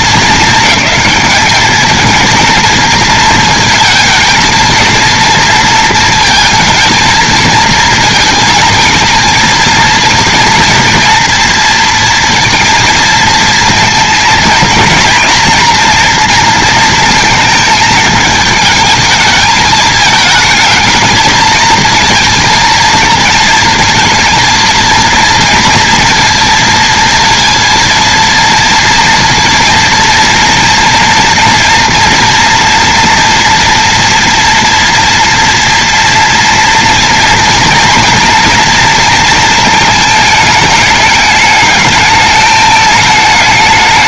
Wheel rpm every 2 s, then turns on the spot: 220, 220, 230, 220, 230, 230, 230, 230, 240, 220, 220, 220, 230, 230, 230, 240, 240, 230, 230, 230, 220, 220.
none